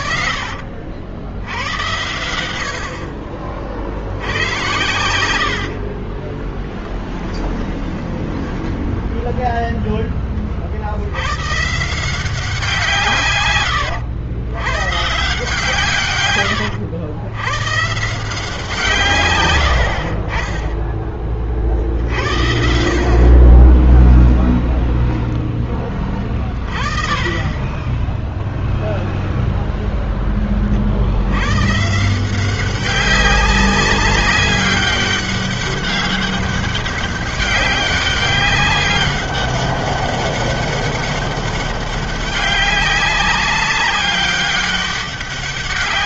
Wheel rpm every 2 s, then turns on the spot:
60, 90, 90, 30, 10, 30, 180, 100, 120, 160, 40, 60, 0, 30, 0, 10, 170, 200, 200, 200, 200, 190, 200.
6-8